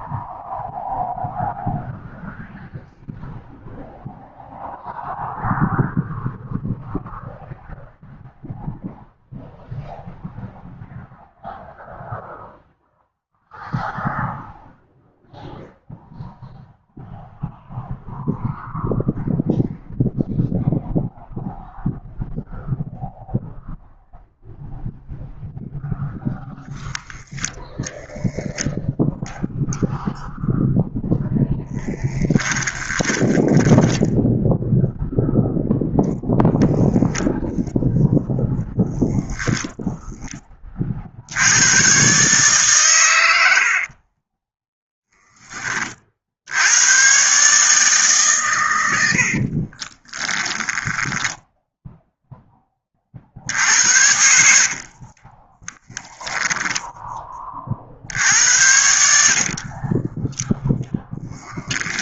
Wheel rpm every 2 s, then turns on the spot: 0, 0, 0, 0, 0, 0, 0, 0, 0, 0, 0, 0, 0, 0, 0, 0, 10, 0, 0, 0, 50, 120, 10, 110, 80, 10, 40, 30, 20, 70, 0.
32-34 50-52 54-56 58-60